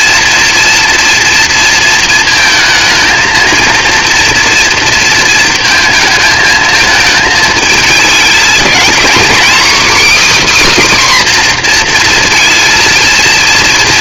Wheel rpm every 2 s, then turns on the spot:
240, 230, 230, 220, 230, 290, 230.
none